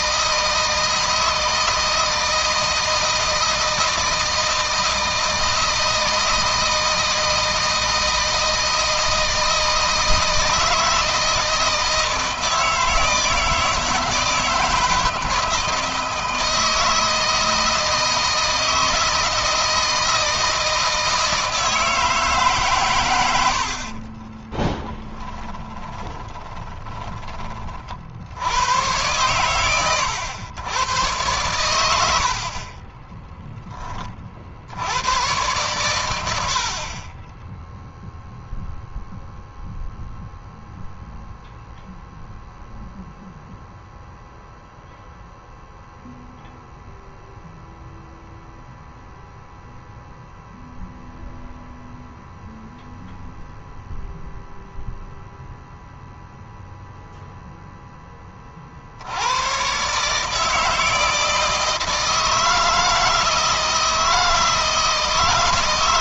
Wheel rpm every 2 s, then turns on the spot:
160, 160, 160, 160, 160, 160, 160, 160, 160, 160, 160, 110, 10, 20, 100, 120, 20, 90, 30, 0, 0, 0, 0, 0, 0, 0, 0, 0, 0, 60, 160, 160, 160.
22-28 32-34